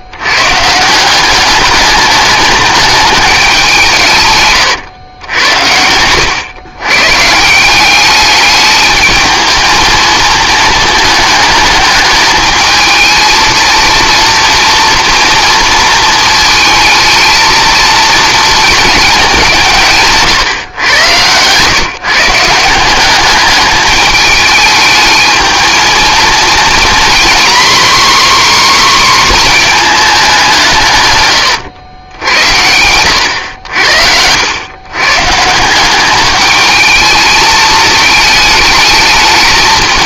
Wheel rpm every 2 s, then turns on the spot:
150, 210, 130, 120, 210, 220, 220, 230, 220, 220, 120, 170, 210, 230, 270, 180, 90, 110, 210, 220.
none